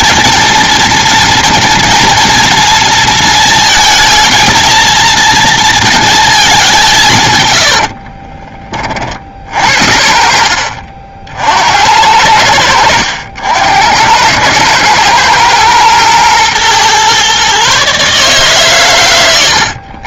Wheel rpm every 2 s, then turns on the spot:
240, 220, 230, 180, 30, 60, 80, 110, 120, 120.
none